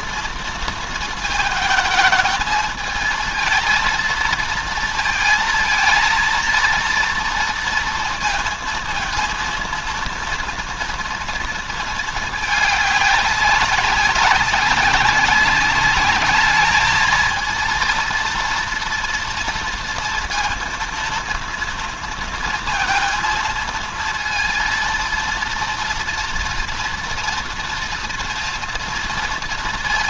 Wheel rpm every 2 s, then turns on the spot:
230, 220, 230, 230, 230, 230, 210, 190, 210, 240, 230, 230, 230, 230, 230.
none